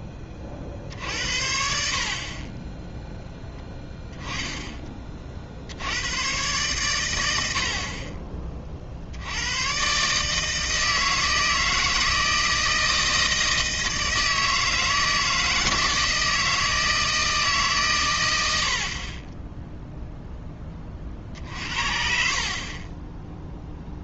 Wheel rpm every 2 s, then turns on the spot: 30, 20, 10, 130, 40, 160, 160, 160, 160, 120, 30, 40.
none